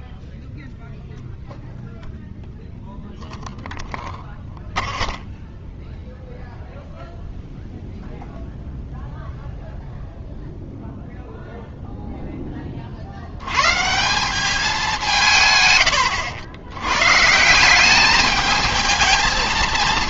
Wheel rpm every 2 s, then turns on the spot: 0, 0, 0, 0, 0, 0, 20, 190, 100, 220.
none